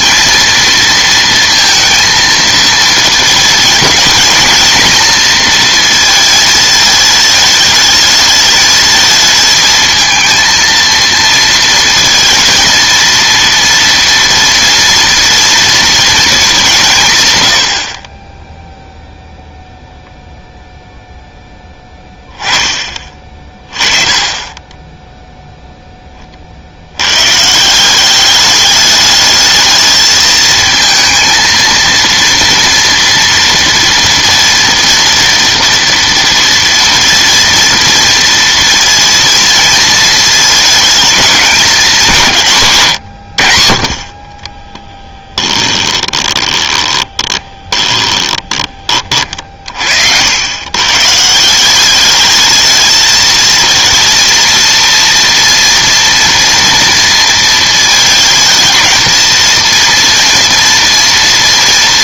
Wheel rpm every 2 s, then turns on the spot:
230, 230, 230, 220, 220, 230, 230, 240, 190, 0, 0, 20, 20, 50, 210, 230, 230, 230, 230, 230, 220, 130, 20, 30, 20, 120, 220, 230, 230, 220, 230.
44-48